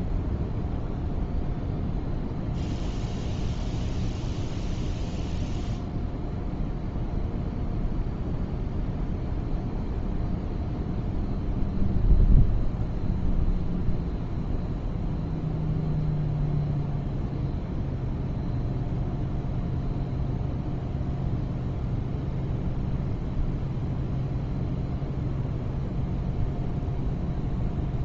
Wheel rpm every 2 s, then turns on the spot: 0, 0, 0, 0, 0, 0, 0, 0, 0, 0, 0, 0, 0, 0.
none